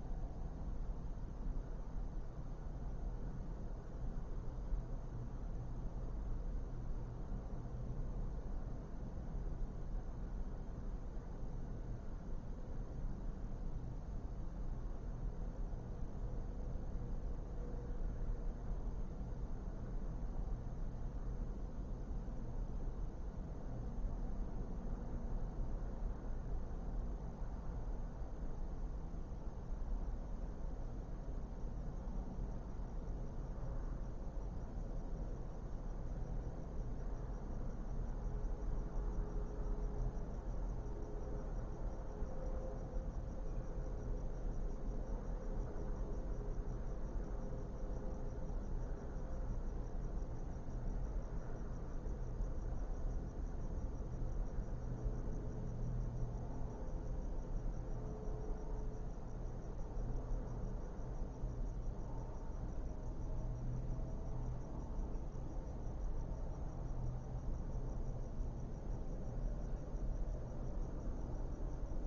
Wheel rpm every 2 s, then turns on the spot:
0, 0, 0, 0, 0, 0, 0, 0, 0, 0, 0, 0, 0, 0, 0, 0, 0, 0, 0, 0, 0, 0, 0, 0, 0, 0, 0, 0, 0, 0, 0, 0, 0, 0, 0, 0.
none